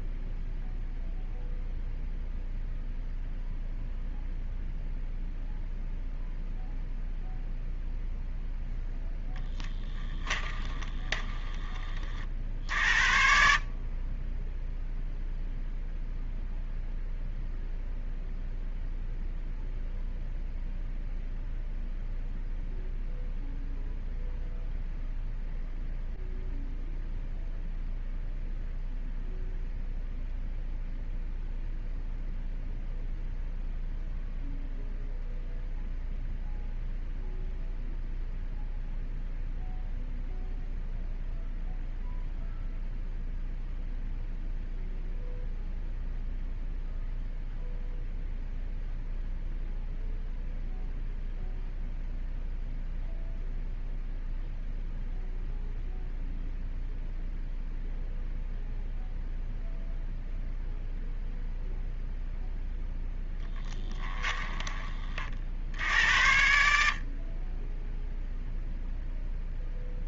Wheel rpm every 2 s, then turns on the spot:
0, 0, 0, 0, 0, 20, 60, 0, 0, 0, 0, 0, 0, 0, 0, 0, 0, 0, 0, 0, 0, 0, 0, 0, 0, 0, 0, 0, 0, 0, 0, 0, 30, 60, 0.
10-12